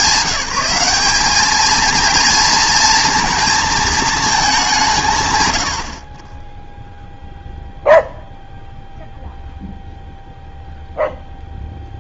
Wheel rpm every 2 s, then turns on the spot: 190, 230, 180, 0, 0, 0.
none